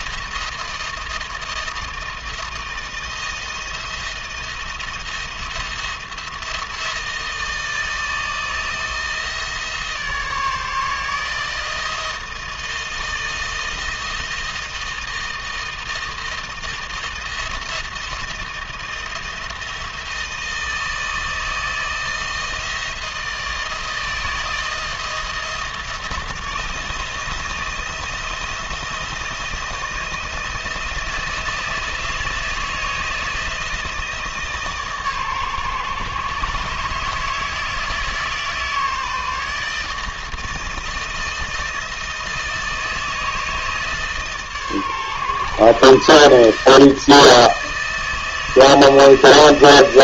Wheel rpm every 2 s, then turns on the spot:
160, 160, 170, 160, 160, 160, 160, 160, 160, 170, 160, 160, 170, 170, 160, 160, 160, 140, 150, 160, 160, 160, 140, 160, 160.
none